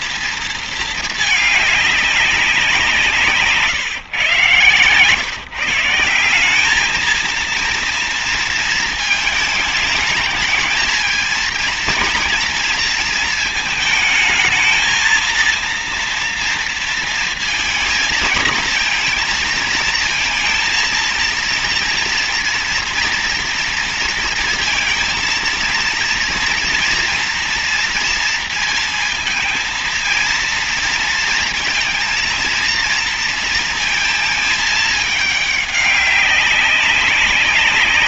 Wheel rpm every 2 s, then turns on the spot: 230, 190, 120, 190, 230, 220, 230, 220, 230, 230, 230, 230, 230, 230, 230, 230, 230, 220, 190.
none